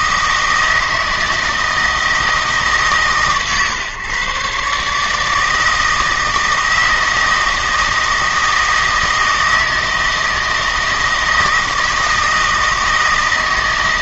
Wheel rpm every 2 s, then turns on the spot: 160, 150, 140, 160, 160, 160, 160.
none